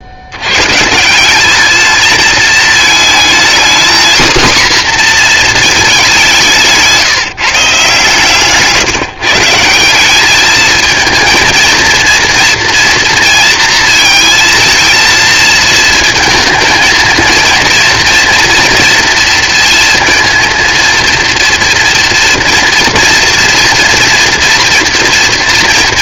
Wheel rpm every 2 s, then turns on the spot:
120, 220, 250, 170, 150, 220, 230, 220, 230, 230, 230, 230, 230.
6-8